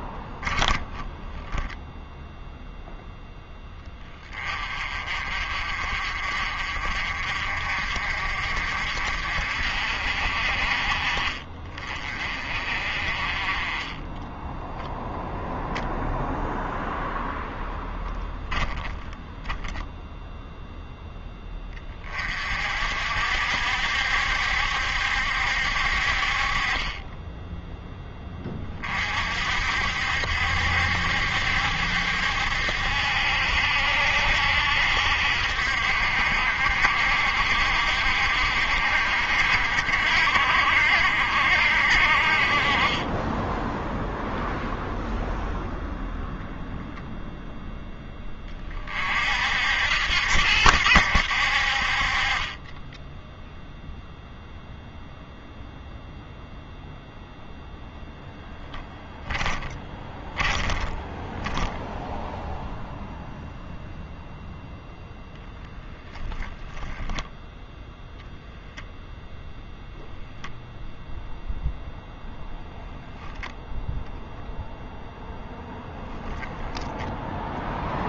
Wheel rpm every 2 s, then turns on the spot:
10, 0, 30, 40, 50, 40, 40, 0, 0, 10, 0, 40, 70, 40, 30, 70, 70, 70, 60, 60, 60, 30, 0, 0, 30, 80, 20, 0, 0, 0, 10, 0, 0, 10, 0, 0, 0, 0, 10.
60-62